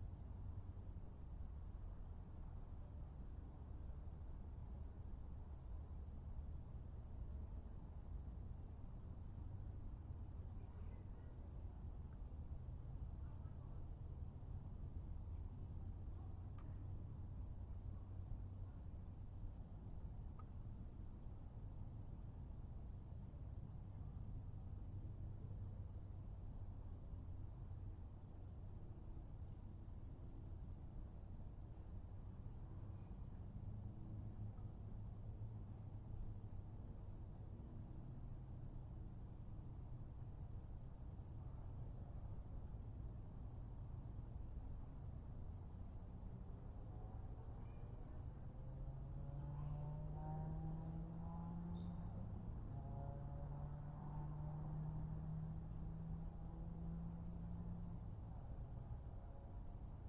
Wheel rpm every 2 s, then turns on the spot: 0, 0, 0, 0, 0, 0, 0, 0, 0, 0, 0, 0, 0, 0, 0, 0, 0, 0, 0, 0, 0, 0, 0, 0, 0, 0, 0, 0, 0, 0.
none